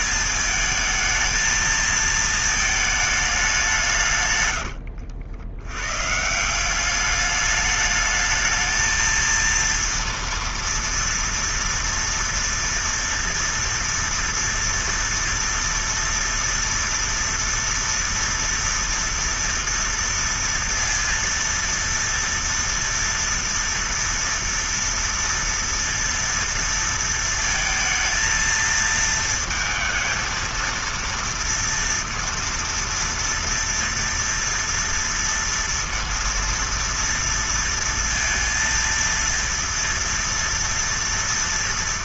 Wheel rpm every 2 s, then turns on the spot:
220, 220, 100, 180, 220, 230, 230, 240, 230, 230, 230, 230, 230, 230, 230, 230, 230, 230, 230, 230, 230.
4-6